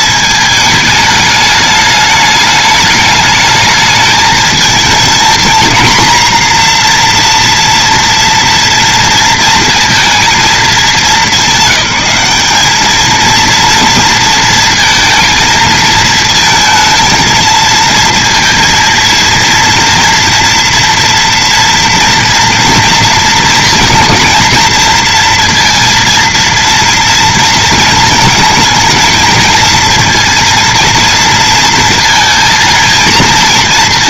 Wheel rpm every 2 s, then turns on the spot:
220, 210, 220, 240, 230, 210, 200, 230, 220, 230, 240, 230, 220, 230, 220, 230, 230.
none